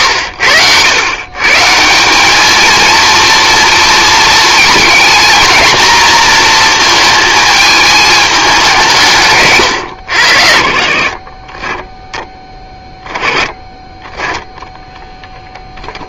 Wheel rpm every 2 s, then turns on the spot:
110, 230, 220, 230, 170, 50, 10, 0.
none